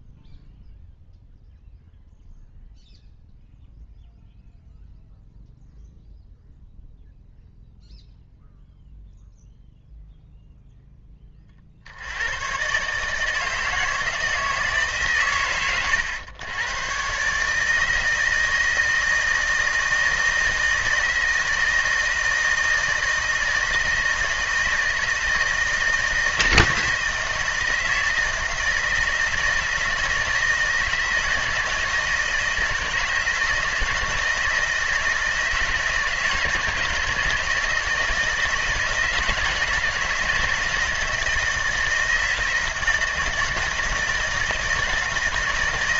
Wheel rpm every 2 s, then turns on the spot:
0, 0, 0, 0, 0, 0, 130, 150, 110, 160, 160, 160, 160, 160, 160, 160, 160, 170, 160, 160, 170, 160, 160.
none